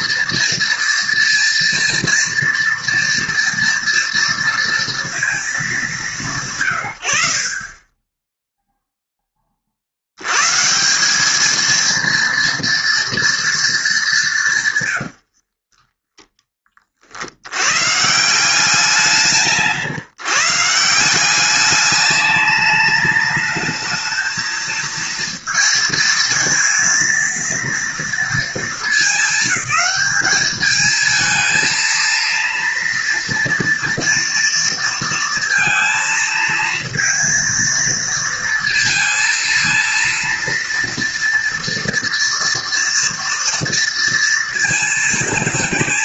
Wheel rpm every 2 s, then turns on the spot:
230, 240, 230, 140, 0, 130, 230, 150, 20, 170, 160, 210, 220, 230, 220, 210, 230, 230, 230, 230, 230, 230, 230.
none